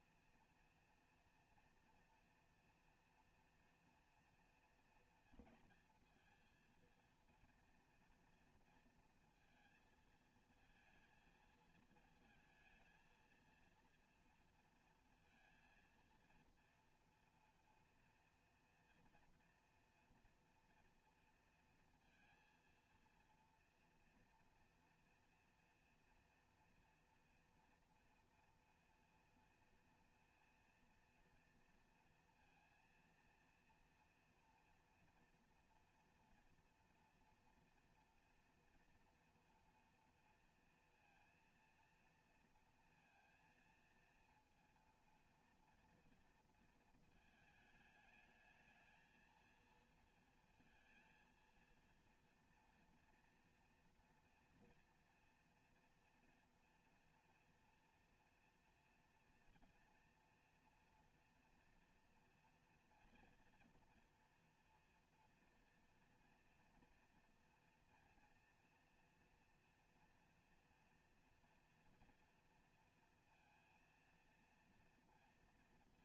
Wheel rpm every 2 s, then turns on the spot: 230, 230, 230, 230, 230, 230, 230, 230, 230, 230, 230, 230, 230, 230, 240, 230, 230, 240, 240, 230, 230, 230, 230, 220, 220, 230, 230, 230, 230, 230, 230, 230, 240, 230, 230, 230, 230, 230.
none